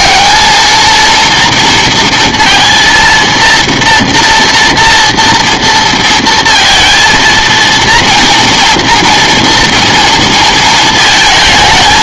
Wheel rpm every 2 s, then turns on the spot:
230, 230, 230, 230, 230, 220.
none